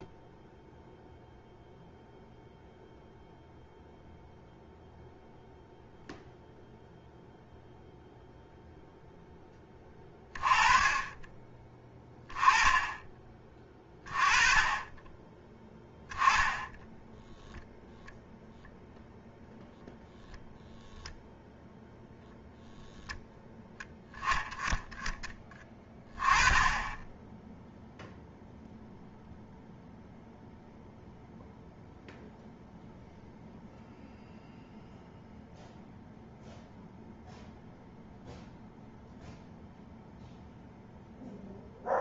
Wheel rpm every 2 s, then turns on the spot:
0, 0, 0, 0, 10, 20, 20, 10, 0, 0, 0, 0, 20, 10, 0, 0, 0, 0, 0, 0, 0.
none